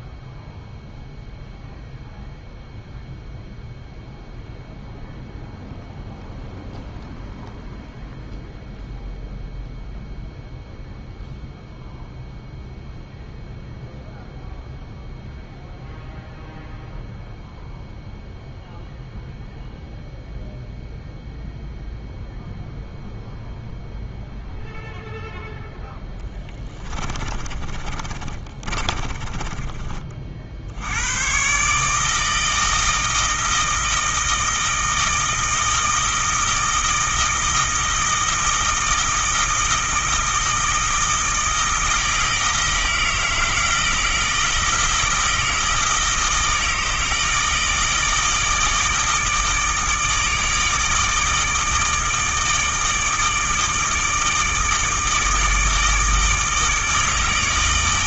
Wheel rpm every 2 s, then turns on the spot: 0, 0, 0, 0, 0, 0, 0, 0, 0, 0, 0, 0, 0, 20, 30, 80, 160, 160, 160, 160, 160, 160, 160, 160, 160, 150, 160, 160, 160.
26-30